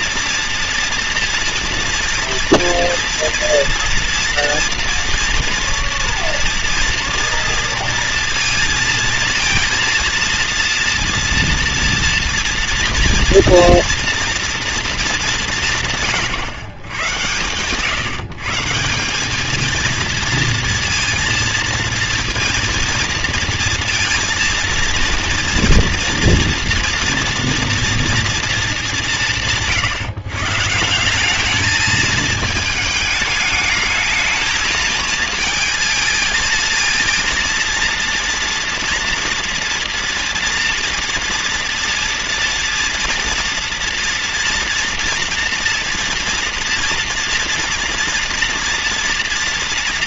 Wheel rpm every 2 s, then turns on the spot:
230, 230, 230, 230, 230, 230, 230, 230, 120, 170, 230, 230, 230, 240, 220, 170, 220, 220, 230, 230, 230, 240, 230, 230, 230.
none